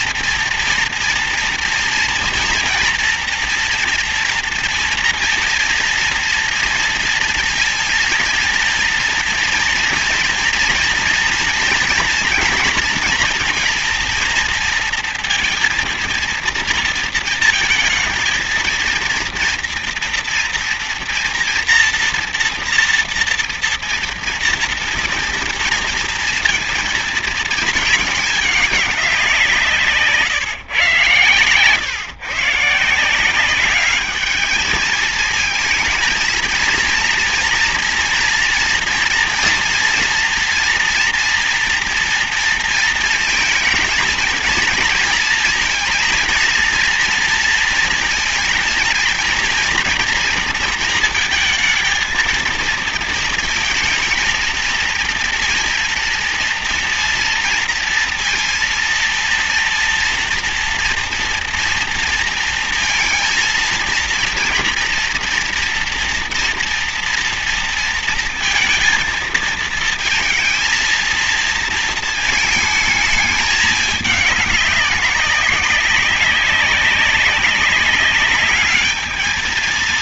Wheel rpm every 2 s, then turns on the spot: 230, 230, 230, 230, 230, 230, 230, 230, 230, 230, 230, 230, 230, 230, 200, 140, 150, 220, 230, 230, 230, 230, 230, 230, 230, 230, 230, 230, 230, 230, 240, 230, 230, 240, 230, 230, 220, 200, 200, 210.
none